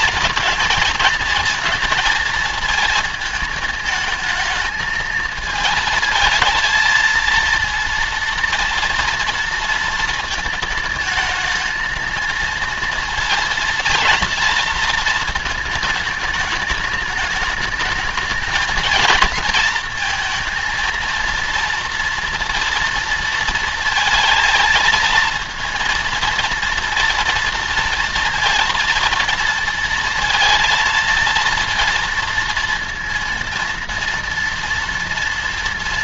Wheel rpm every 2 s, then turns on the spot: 230, 230, 220, 220, 230, 220, 230, 230, 210, 210, 220, 230, 220, 230, 230, 230, 230, 230.
none